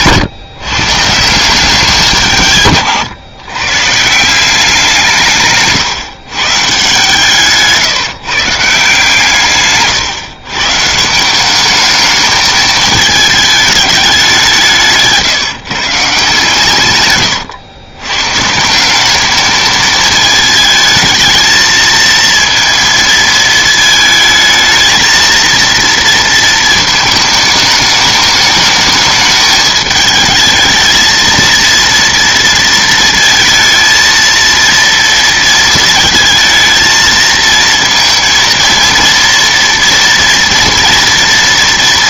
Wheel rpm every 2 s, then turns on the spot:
170, 140, 180, 140, 160, 130, 210, 180, 140, 150, 220, 230, 220, 220, 210, 220, 230, 230, 220, 230, 230.
none